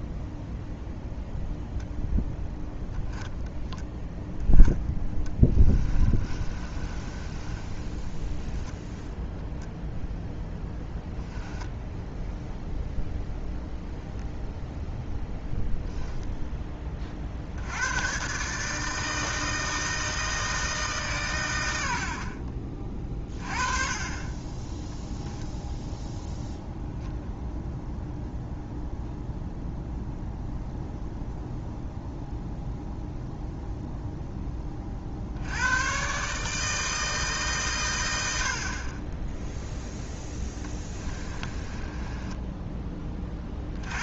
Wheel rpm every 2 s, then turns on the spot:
0, 0, 0, 30, 10, 10, 0, 0, 10, 140, 160, 40, 20, 0, 0, 0, 0, 20, 150, 70, 10, 10.
6-12 40-42